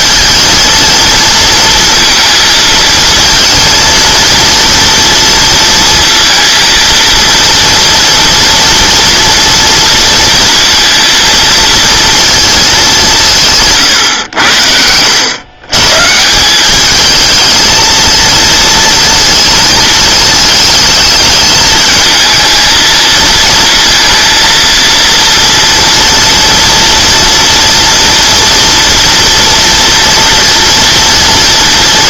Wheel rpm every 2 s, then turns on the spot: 230, 230, 230, 230, 230, 230, 220, 90, 190, 230, 220, 220, 230, 230, 230, 230.
none